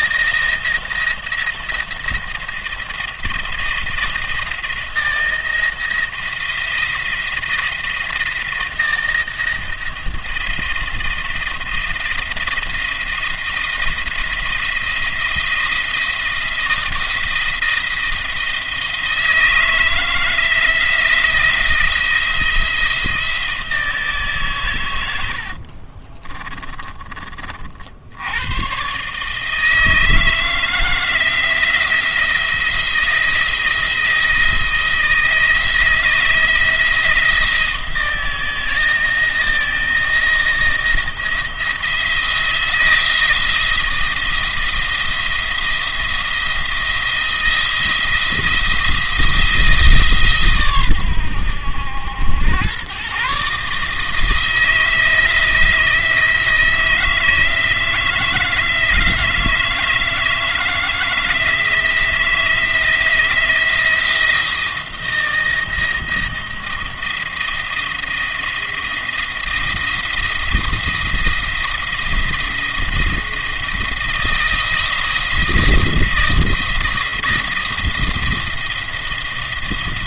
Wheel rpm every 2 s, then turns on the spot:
170, 160, 160, 170, 170, 170, 170, 170, 160, 160, 160, 160, 100, 30, 130, 160, 170, 160, 160, 160, 170, 170, 170, 170, 160, 120, 120, 160, 160, 160, 160, 170, 170, 170, 170, 170, 170, 170, 170, 170.
24-26